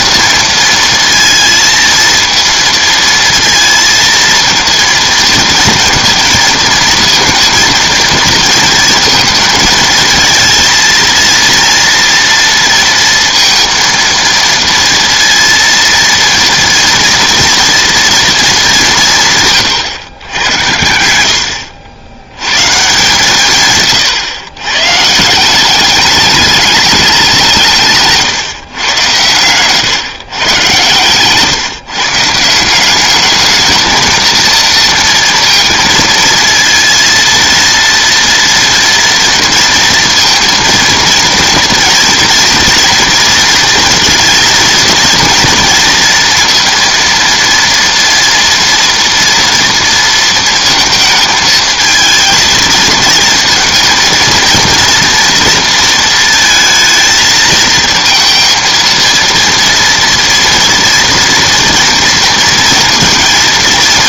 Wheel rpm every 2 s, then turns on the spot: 230, 230, 230, 230, 220, 230, 230, 230, 230, 170, 80, 140, 140, 200, 110, 120, 200, 230, 230, 230, 230, 230, 230, 230, 230, 220, 230, 230, 230, 230, 230, 230.
none